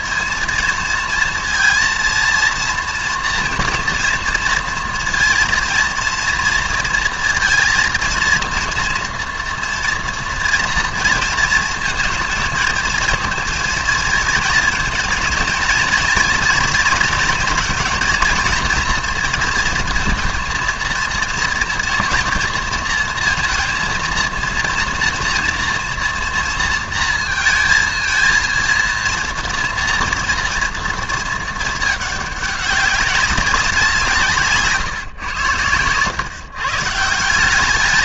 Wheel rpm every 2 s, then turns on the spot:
230, 230, 230, 230, 230, 230, 220, 230, 220, 230, 230, 230, 230, 230, 230, 230, 200, 140, 140.
none